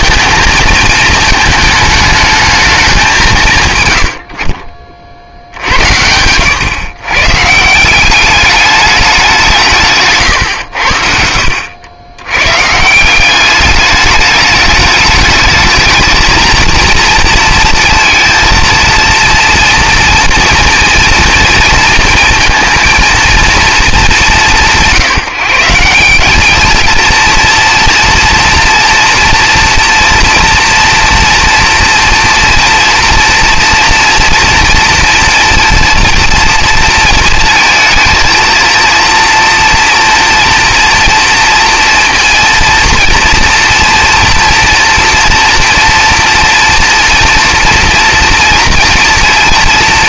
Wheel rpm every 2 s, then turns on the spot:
230, 210, 50, 120, 200, 80, 140, 210, 220, 230, 230, 230, 170, 230, 240, 240, 230, 230, 230, 230, 230, 230, 240, 240, 230.
none